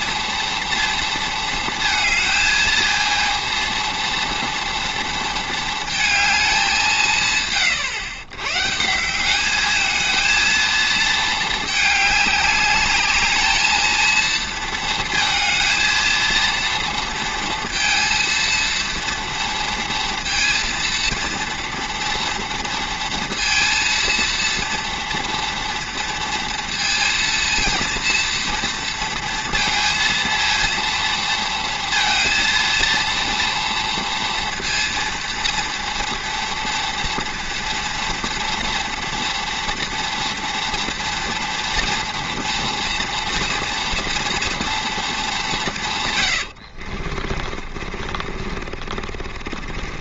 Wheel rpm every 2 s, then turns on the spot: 230, 220, 230, 190, 130, 230, 200, 230, 230, 230, 230, 230, 230, 230, 230, 230, 230, 230, 230, 230, 230, 230, 230, 70, 50.
46-50